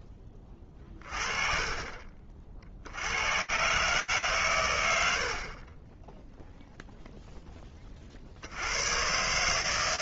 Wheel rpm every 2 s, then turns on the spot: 20, 80, 80, 0, 140.
none